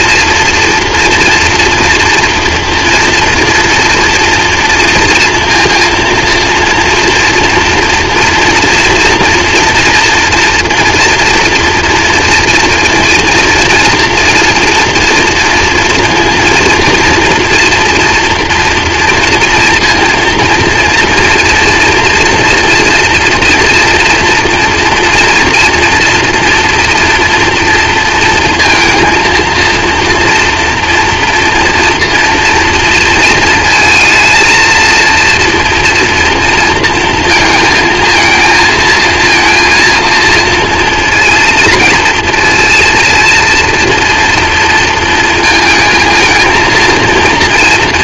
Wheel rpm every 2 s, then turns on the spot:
230, 240, 230, 230, 230, 240, 230, 230, 240, 230, 230, 230, 230, 230, 230, 230, 230, 230, 230, 220, 230, 230, 230, 230.
none